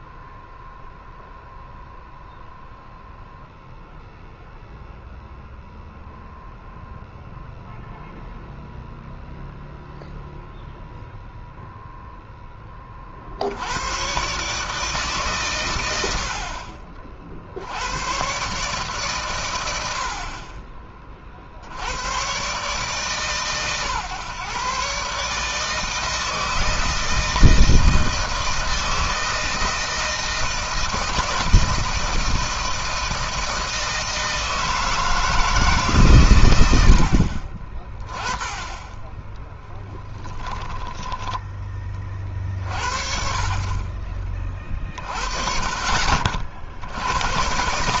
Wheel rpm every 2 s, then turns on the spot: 0, 0, 0, 0, 0, 0, 10, 140, 50, 140, 40, 140, 140, 160, 160, 160, 160, 160, 90, 10, 10, 50, 30, 70.
40-42